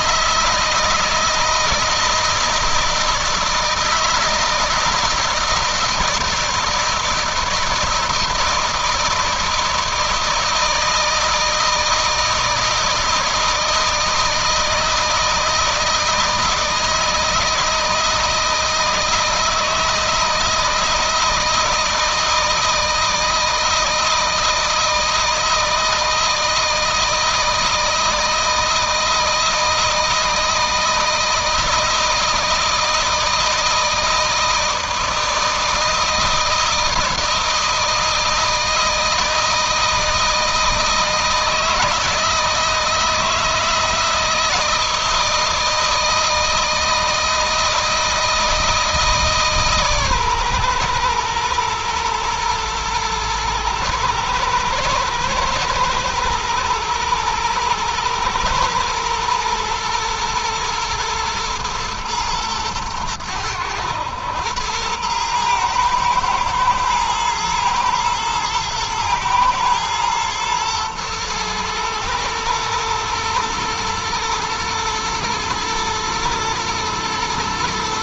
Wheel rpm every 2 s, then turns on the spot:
160, 160, 160, 170, 160, 160, 160, 160, 160, 160, 160, 160, 160, 160, 160, 160, 160, 160, 160, 160, 160, 160, 160, 160, 160, 120, 120, 110, 110, 120, 120, 110, 110, 110, 110, 110, 120, 120, 110.
none